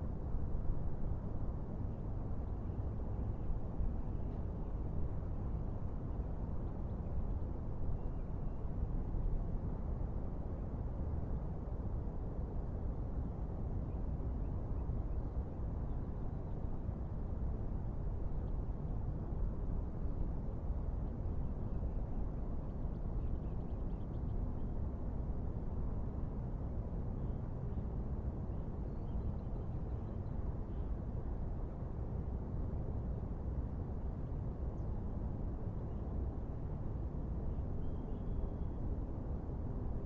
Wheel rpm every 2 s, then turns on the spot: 0, 0, 0, 0, 0, 0, 0, 0, 0, 0, 0, 0, 0, 0, 0, 0, 0, 0, 0, 0.
none